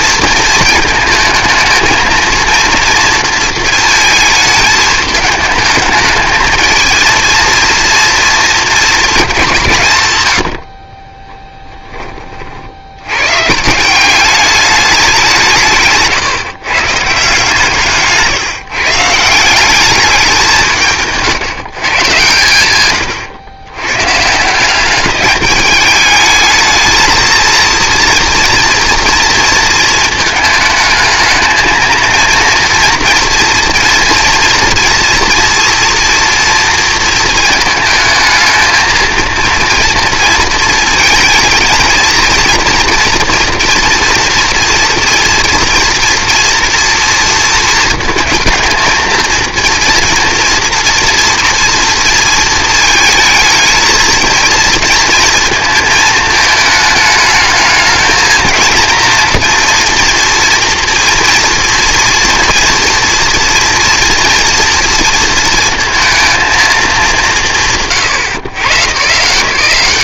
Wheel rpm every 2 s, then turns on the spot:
230, 230, 220, 220, 230, 50, 60, 200, 130, 160, 170, 120, 180, 220, 230, 220, 240, 230, 230, 220, 230, 230, 230, 230, 220, 230, 220, 220, 220, 230, 230, 230, 230, 220, 150.
none